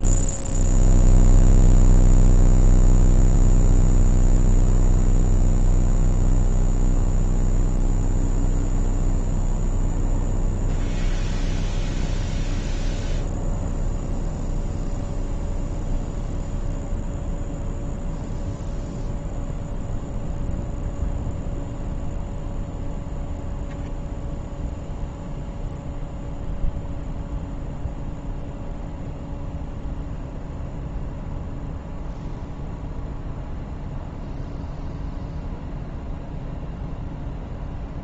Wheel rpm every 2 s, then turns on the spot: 0, 0, 0, 0, 0, 0, 0, 0, 0, 0, 0, 0, 0, 0, 0, 0, 0, 0, 0.
none